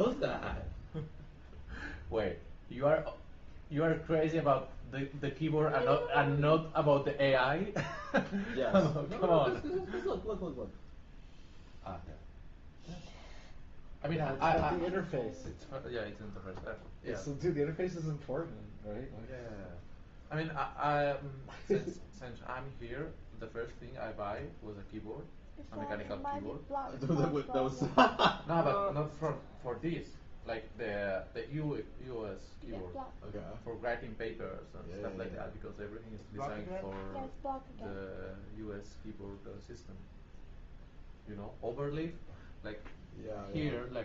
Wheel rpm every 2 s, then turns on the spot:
0, 0, 0, 0, 0, 0, 0, 0, 0, 0, 0, 0, 0, 0, 0, 0, 0, 0, 0, 0, 0, 0.
none